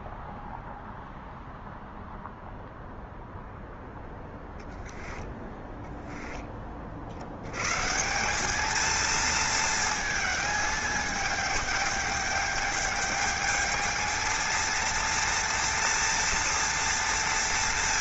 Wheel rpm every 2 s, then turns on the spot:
0, 0, 20, 30, 210, 220, 210, 230, 230.
4-6